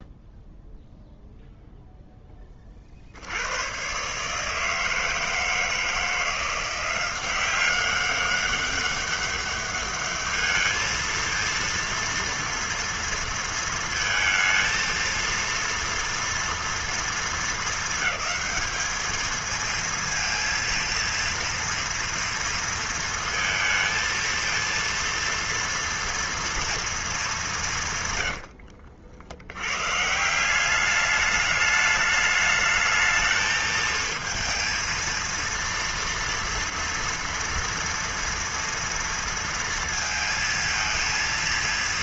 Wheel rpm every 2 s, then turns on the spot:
0, 10, 150, 170, 200, 210, 230, 230, 230, 220, 230, 230, 230, 240, 110, 170, 210, 230, 230, 230, 220.
28-30